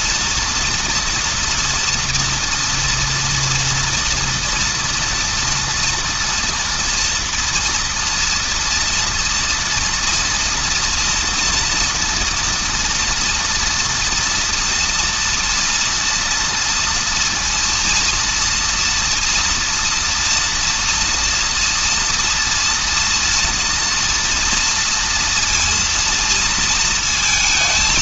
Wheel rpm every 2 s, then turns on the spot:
230, 240, 230, 240, 230, 230, 240, 230, 230, 230, 230, 240, 230, 230.
none